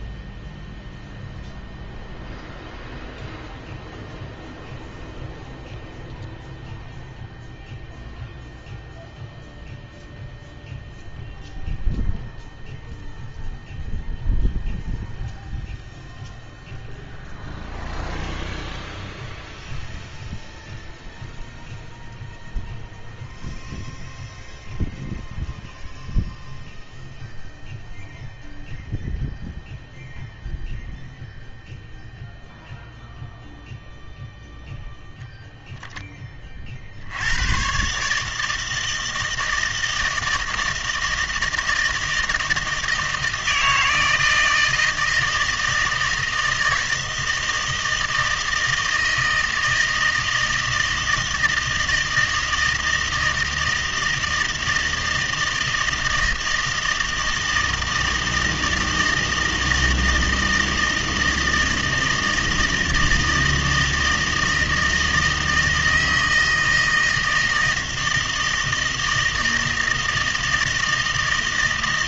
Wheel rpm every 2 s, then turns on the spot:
0, 0, 0, 0, 0, 0, 0, 0, 0, 0, 0, 0, 0, 0, 0, 0, 0, 10, 40, 160, 160, 160, 160, 160, 160, 160, 160, 160, 160, 160, 160, 160, 160, 160, 160, 160.
none